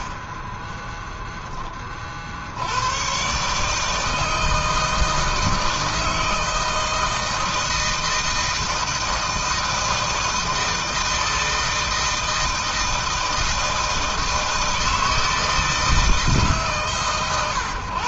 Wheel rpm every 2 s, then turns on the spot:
10, 130, 160, 160, 160, 160, 160, 160, 140.
none